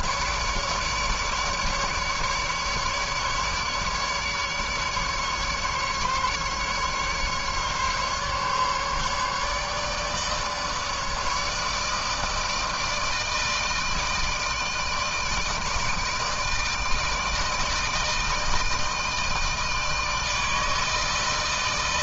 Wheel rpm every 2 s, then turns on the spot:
150, 150, 150, 140, 140, 150, 160, 160, 160, 160, 160.
none